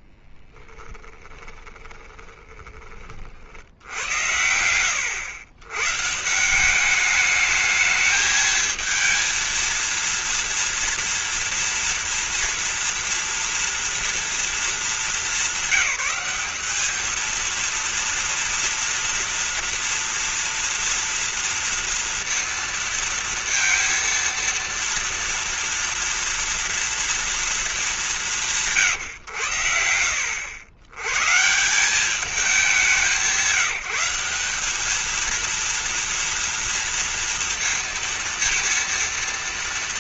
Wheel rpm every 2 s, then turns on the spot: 20, 20, 90, 160, 220, 230, 230, 220, 200, 230, 230, 230, 230, 230, 190, 80, 200, 190, 230, 230.
0-4